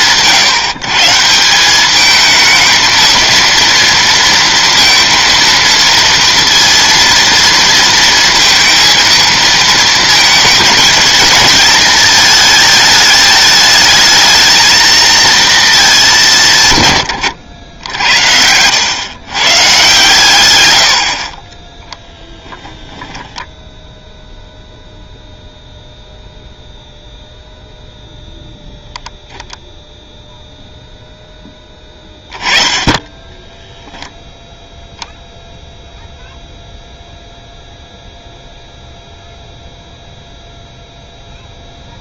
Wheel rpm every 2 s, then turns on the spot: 160, 220, 230, 230, 220, 220, 220, 220, 150, 100, 110, 10, 0, 0, 0, 0, 10, 0, 0, 0, 0.
22-24